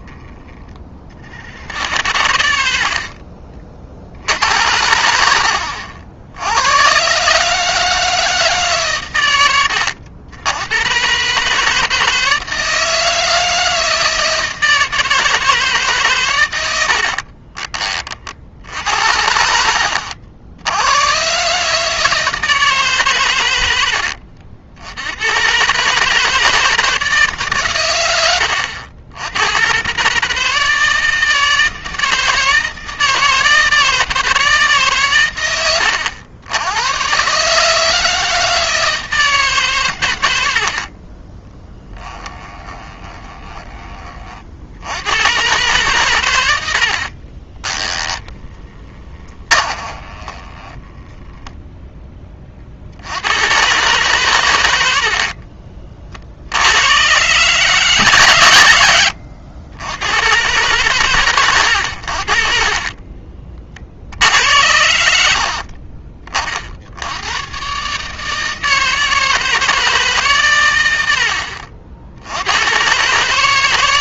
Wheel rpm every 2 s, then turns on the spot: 50, 60, 80, 120, 120, 130, 160, 160, 60, 70, 120, 130, 100, 160, 90, 160, 160, 130, 120, 160, 30, 20, 100, 60, 20, 10, 80, 60, 110, 90, 110, 40, 70, 80, 160, 80, 140.
2-6 16-18 40-44 46-52 54-56 58-60 62-64